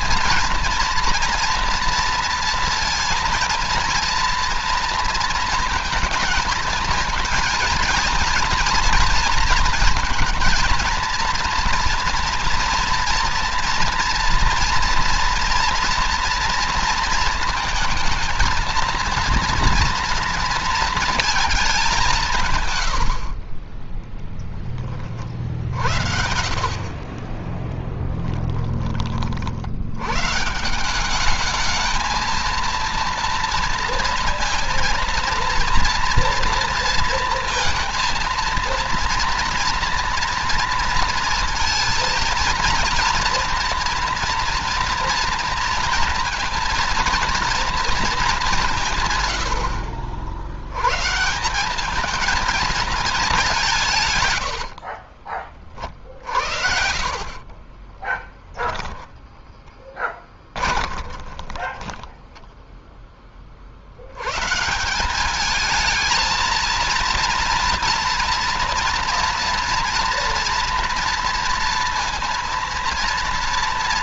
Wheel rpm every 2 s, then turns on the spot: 240, 230, 230, 230, 230, 230, 240, 230, 230, 230, 230, 120, 30, 40, 20, 160, 230, 230, 230, 230, 230, 230, 230, 230, 190, 60, 220, 110, 50, 20, 10, 10, 120, 220, 230, 230, 230.
26-28 58-64